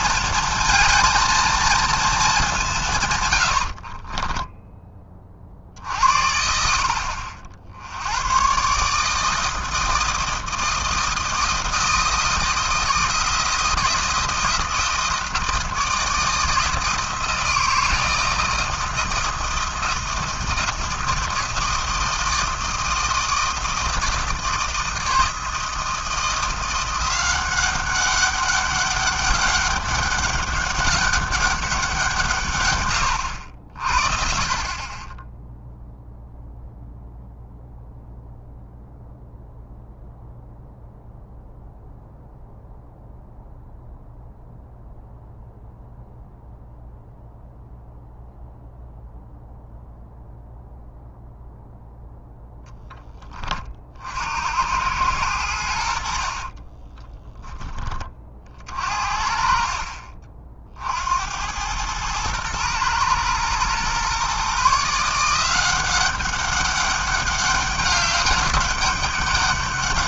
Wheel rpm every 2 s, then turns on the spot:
230, 170, 10, 70, 140, 160, 160, 170, 160, 160, 160, 160, 160, 170, 200, 200, 110, 30, 0, 0, 0, 0, 0, 0, 0, 0, 0, 90, 30, 40, 60, 120, 150, 200, 200.
56-58